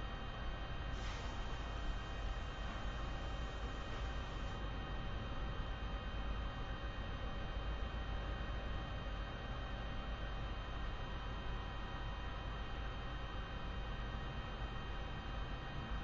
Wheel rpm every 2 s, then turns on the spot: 0, 0, 0, 0, 0, 0, 0, 0.
none